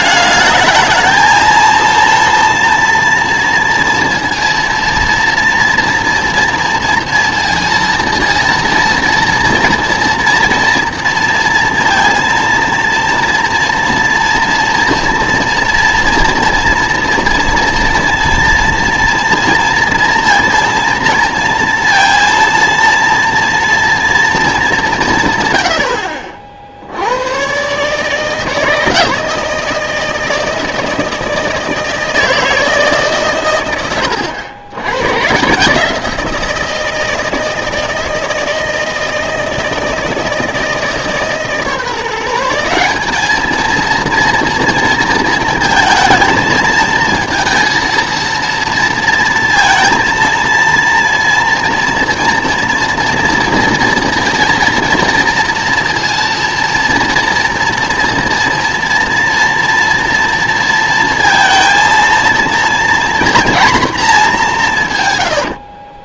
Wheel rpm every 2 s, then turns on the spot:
220, 230, 230, 230, 230, 230, 230, 240, 230, 230, 230, 230, 220, 60, 160, 160, 160, 90, 170, 160, 160, 180, 230, 220, 230, 230, 230, 230, 230, 230, 230, 230, 190.
none